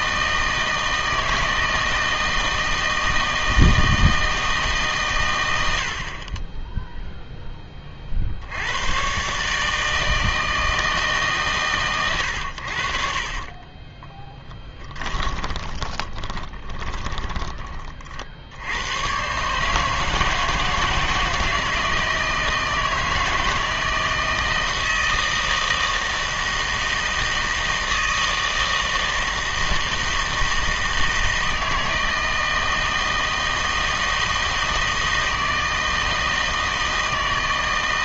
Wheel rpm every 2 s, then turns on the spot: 160, 160, 150, 10, 90, 160, 70, 20, 20, 80, 160, 160, 160, 160, 160, 160, 160, 160, 160.
14-18